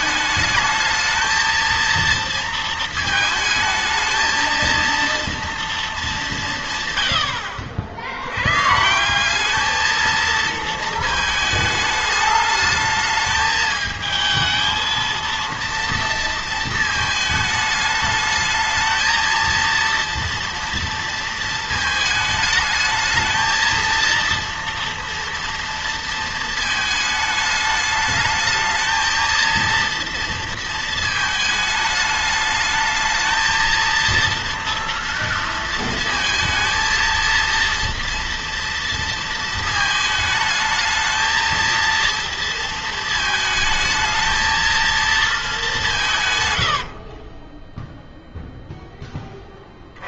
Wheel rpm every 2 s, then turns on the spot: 220, 230, 230, 170, 120, 230, 210, 220, 230, 220, 230, 220, 230, 220, 220, 230, 220, 230, 230, 230, 220, 230, 220, 110, 0.
46-48